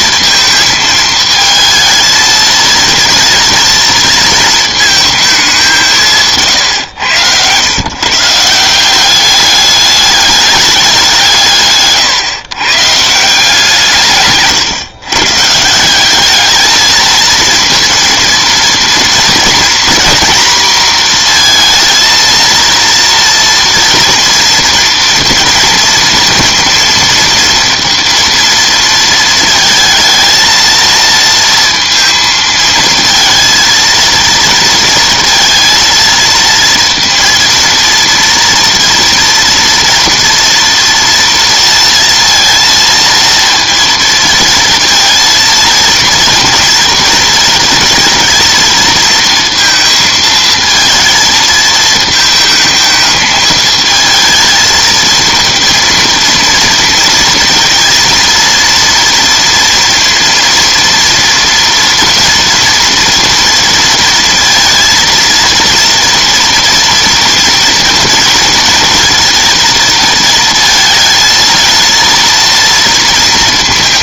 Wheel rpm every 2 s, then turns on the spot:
220, 220, 220, 130, 160, 210, 130, 150, 210, 230, 230, 230, 230, 230, 230, 220, 220, 230, 230, 230, 230, 230, 230, 230, 220, 230, 220, 220, 230, 230, 230, 230, 230, 240, 230, 230, 230.
none